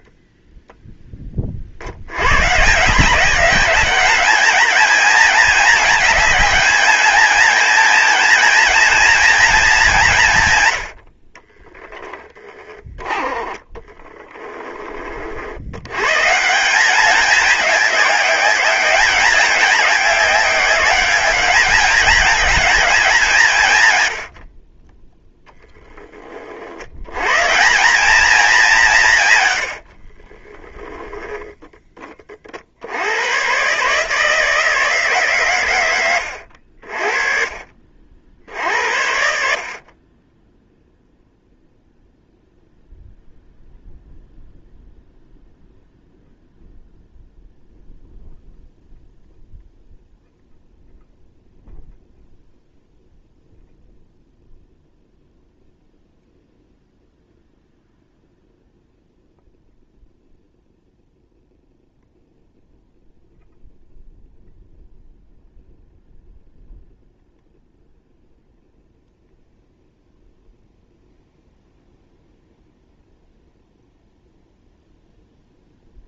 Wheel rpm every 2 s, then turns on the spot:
10, 160, 210, 210, 230, 80, 20, 30, 180, 200, 200, 210, 20, 90, 200, 10, 80, 140, 40, 70, 0, 0, 0, 0, 0, 0, 0, 0, 0, 0, 0, 0, 0, 0, 0, 0, 0, 0.
30-32